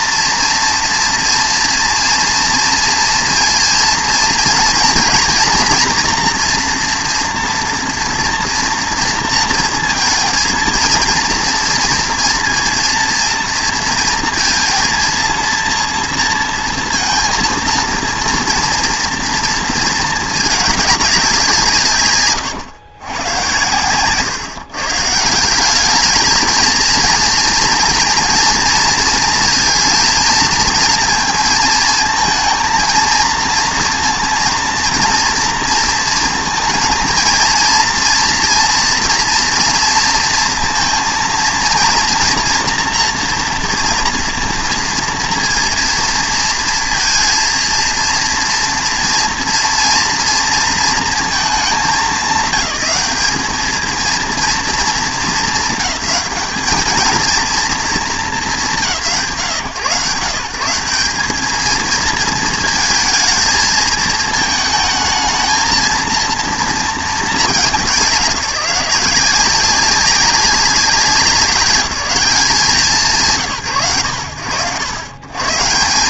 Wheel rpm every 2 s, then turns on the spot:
230, 230, 230, 230, 230, 220, 230, 230, 230, 230, 210, 120, 140, 230, 230, 230, 220, 230, 230, 230, 230, 230, 230, 230, 230, 230, 200, 210, 200, 210, 150, 220, 220, 240, 180, 190, 170, 80.
none